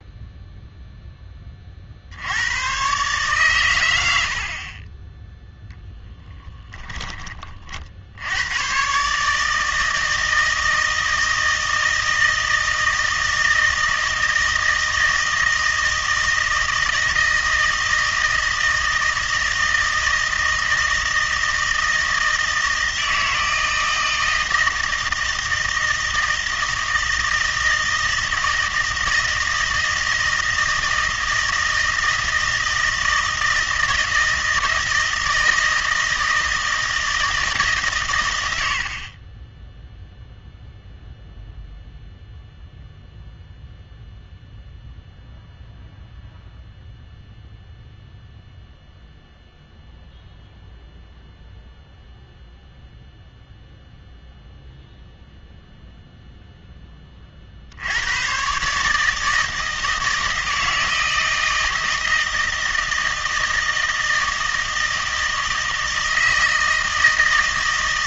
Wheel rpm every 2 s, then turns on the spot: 0, 110, 40, 20, 120, 160, 160, 160, 160, 160, 160, 160, 160, 160, 170, 160, 160, 160, 160, 80, 0, 0, 0, 0, 0, 0, 0, 0, 10, 140, 160, 160, 160, 160.
6-8